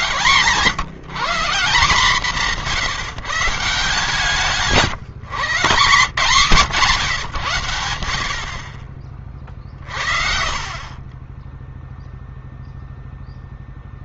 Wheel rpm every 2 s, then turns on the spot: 130, 160, 160, 170, 60, 70, 0.
none